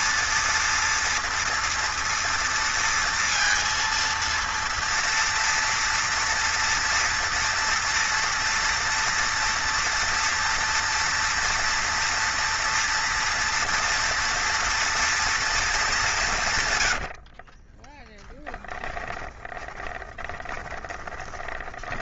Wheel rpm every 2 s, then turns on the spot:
230, 230, 230, 230, 230, 230, 230, 230, 150, 20, 30.
18-22